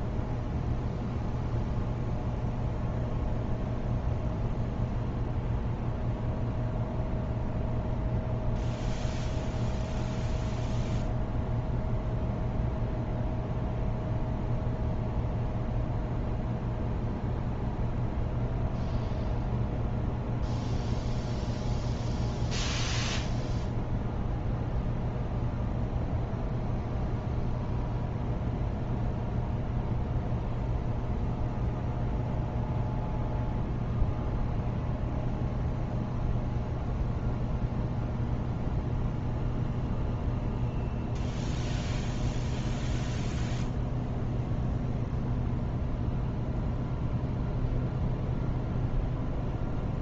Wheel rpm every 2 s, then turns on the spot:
0, 0, 0, 0, 0, 0, 0, 0, 0, 0, 0, 0, 0, 0, 0, 0, 0, 0, 0, 0, 0, 0, 0, 0, 0.
none